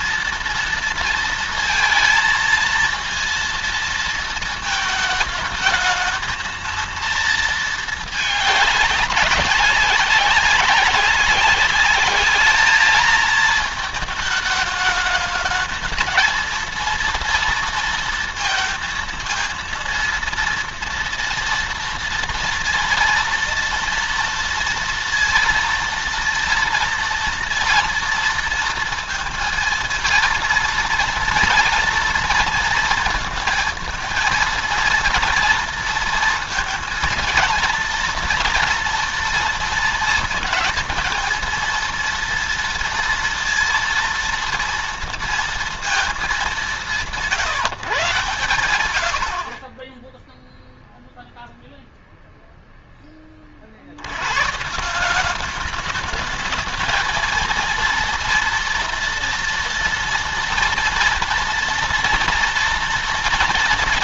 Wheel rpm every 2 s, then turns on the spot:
230, 230, 220, 230, 210, 190, 210, 220, 230, 230, 230, 230, 230, 230, 230, 230, 230, 230, 230, 230, 230, 230, 230, 200, 110, 0, 0, 120, 220, 230, 230, 230.
none